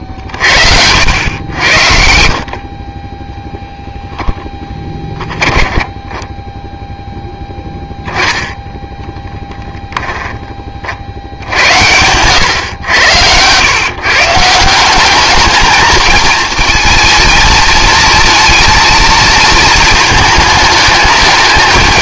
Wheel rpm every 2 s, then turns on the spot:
80, 50, 10, 10, 10, 30, 110, 170, 220, 230, 210.
4-6